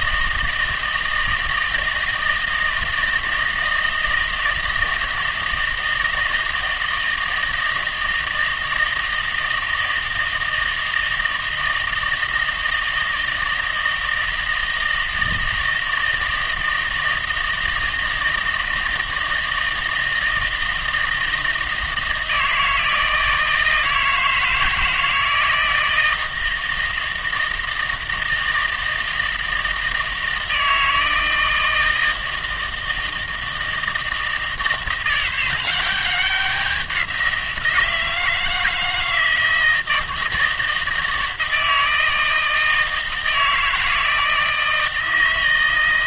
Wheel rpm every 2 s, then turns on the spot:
160, 160, 160, 160, 160, 160, 160, 160, 160, 160, 160, 160, 160, 160, 160, 160, 160, 160, 190, 160, 160, 160, 160.
none